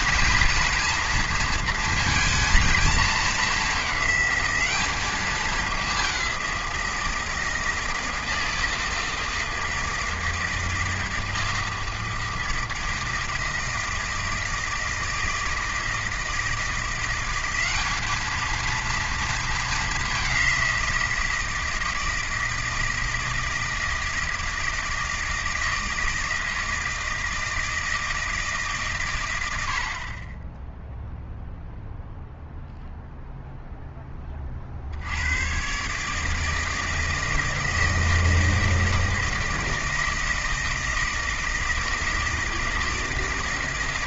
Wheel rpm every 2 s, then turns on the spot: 240, 220, 200, 180, 160, 160, 160, 160, 170, 230, 180, 160, 160, 160, 150, 0, 0, 50, 160, 160, 160, 160.
none